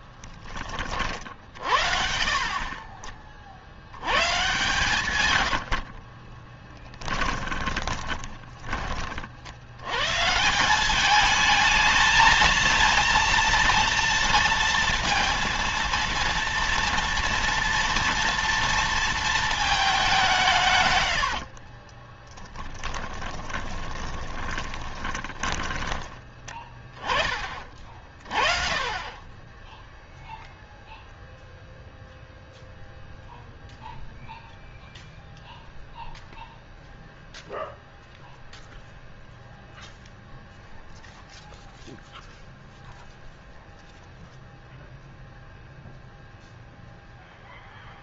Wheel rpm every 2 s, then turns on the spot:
30, 30, 130, 20, 30, 190, 230, 230, 230, 230, 130, 20, 10, 10, 30, 0, 0, 0, 0, 0, 0, 0, 0, 0.
4-8 22-26